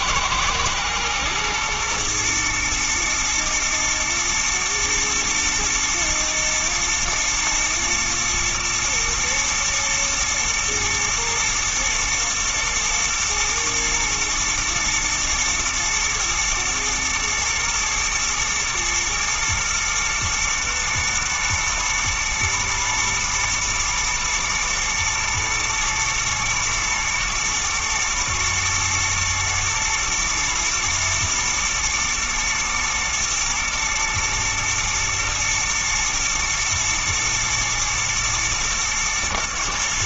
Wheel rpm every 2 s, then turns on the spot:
110, 120, 120, 110, 120, 120, 120, 110, 110, 110, 120, 110, 110, 110, 110, 120, 120, 120, 120, 120.
none